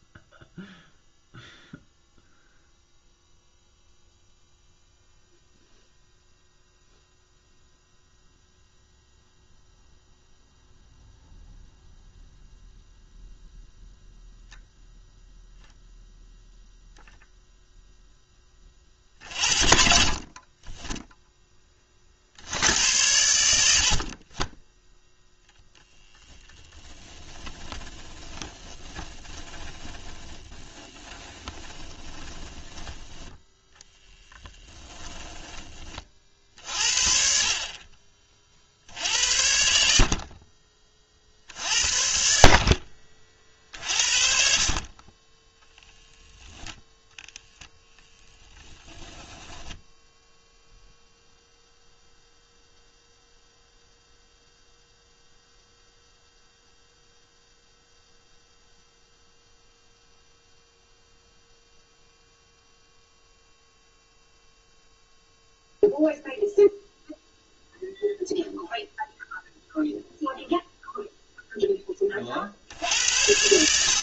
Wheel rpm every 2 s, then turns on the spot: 0, 0, 0, 0, 0, 0, 0, 0, 0, 50, 20, 90, 0, 20, 20, 20, 10, 10, 50, 70, 40, 60, 40, 0, 0, 0, 0, 0, 0, 0, 0, 0, 0, 0, 0, 0, 80.
26-32